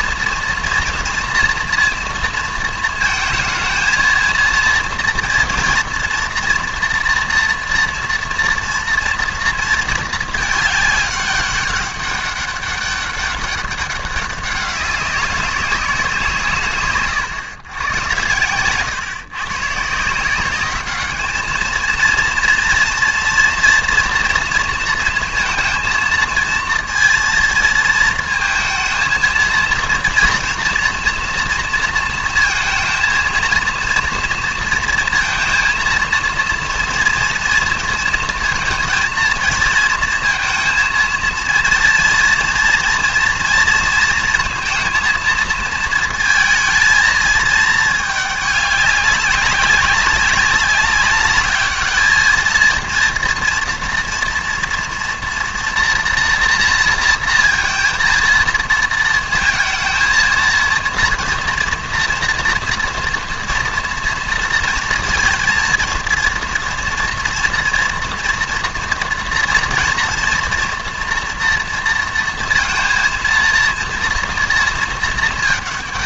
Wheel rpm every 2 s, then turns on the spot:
230, 230, 220, 240, 230, 210, 200, 190, 150, 110, 190, 230, 230, 230, 220, 240, 230, 230, 230, 230, 230, 230, 230, 230, 210, 200, 230, 230, 230, 220, 220, 230, 230, 230, 230, 240, 230, 230.
18-20